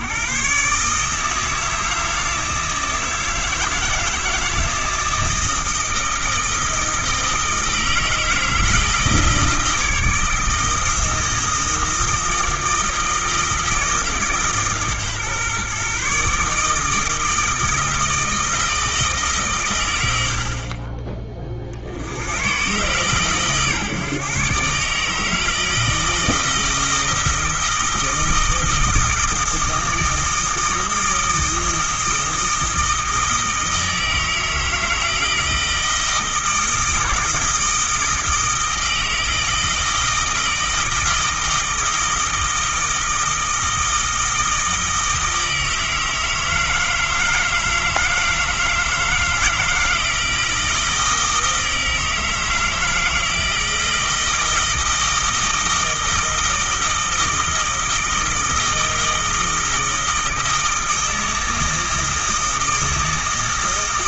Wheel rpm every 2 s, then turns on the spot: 140, 160, 160, 160, 160, 160, 160, 140, 160, 160, 30, 130, 150, 160, 160, 160, 160, 160, 160, 160, 160, 160, 160, 160, 160, 160, 160, 160, 160, 160, 160, 160.
none